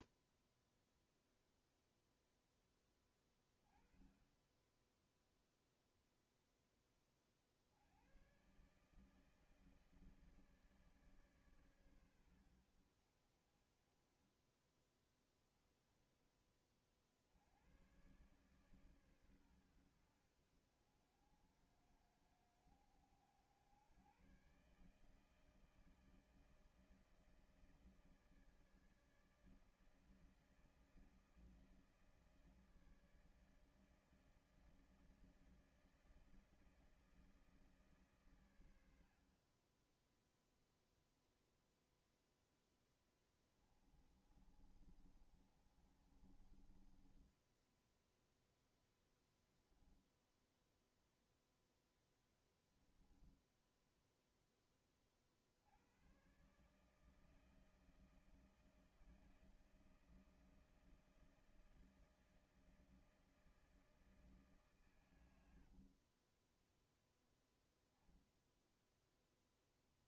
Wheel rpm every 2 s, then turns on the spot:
0, 10, 10, 10, 120, 150, 90, 20, 40, 130, 70, 60, 130, 160, 160, 160, 160, 160, 160, 110, 0, 10, 30, 30, 0, 10, 10, 10, 130, 160, 160, 160, 150, 50, 10.
44-48